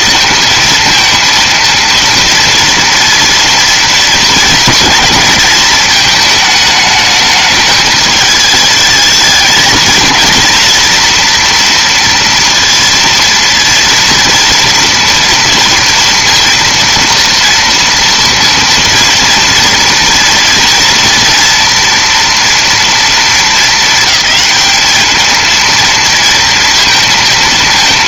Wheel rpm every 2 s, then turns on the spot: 230, 230, 230, 220, 220, 230, 230, 230, 230, 230, 240, 240, 210, 230.
none